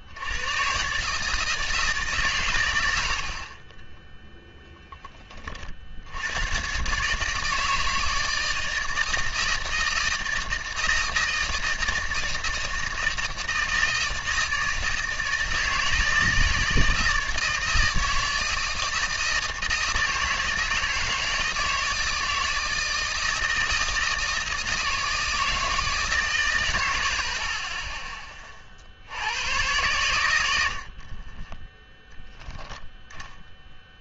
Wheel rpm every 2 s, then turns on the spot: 120, 80, 20, 120, 160, 160, 160, 160, 160, 160, 160, 160, 160, 100, 40, 70, 10.
none